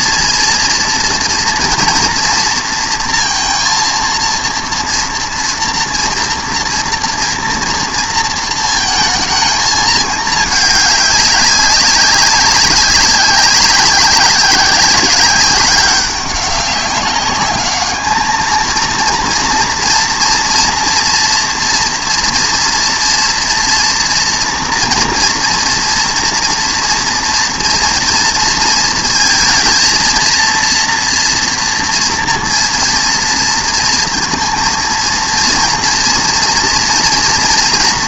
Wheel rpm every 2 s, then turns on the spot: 230, 230, 230, 230, 220, 200, 190, 190, 200, 230, 230, 230, 230, 230, 230, 230, 230, 230, 230.
none